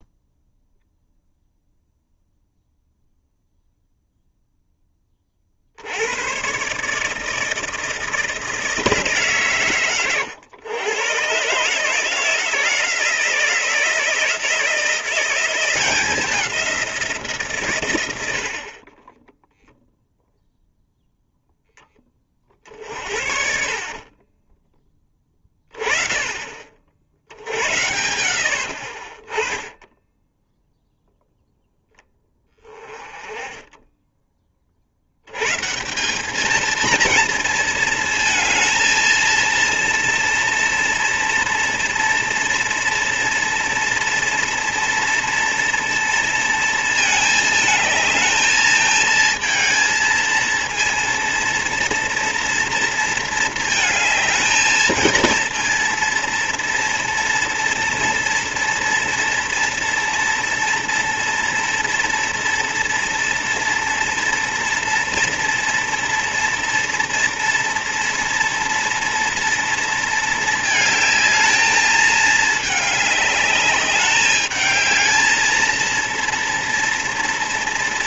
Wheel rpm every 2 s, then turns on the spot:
0, 0, 10, 140, 160, 110, 160, 170, 180, 40, 0, 40, 20, 50, 70, 0, 20, 40, 230, 220, 230, 230, 230, 230, 220, 230, 230, 220, 230, 240, 230, 230, 230, 240, 230, 220, 210, 210, 240.
18-20